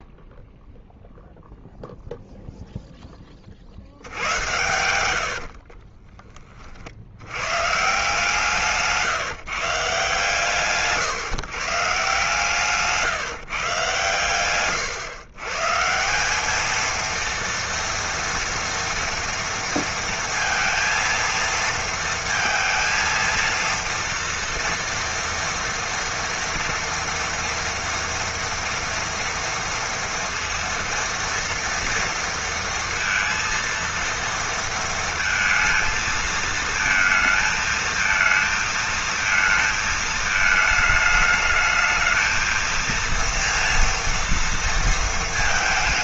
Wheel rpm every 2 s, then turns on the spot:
0, 0, 90, 70, 160, 140, 160, 130, 230, 230, 230, 220, 230, 230, 230, 230, 230, 220, 220, 230, 220, 230, 230.
4-6